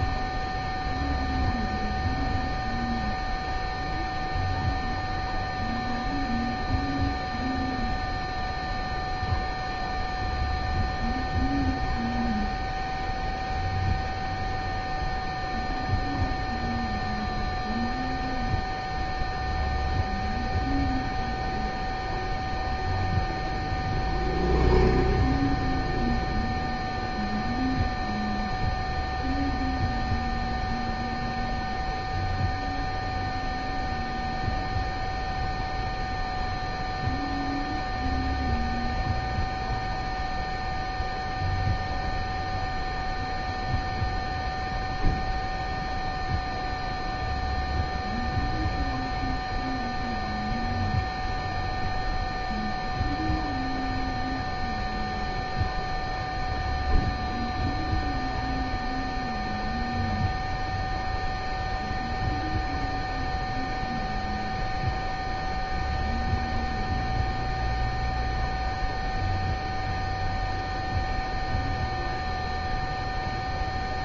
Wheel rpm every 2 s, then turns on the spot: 0, 0, 0, 0, 0, 0, 0, 0, 0, 0, 0, 0, 0, 0, 0, 0, 0, 0, 0, 0, 0, 0, 0, 0, 0, 0, 0, 0, 0, 0, 0, 0, 0, 0, 0, 0, 0.
none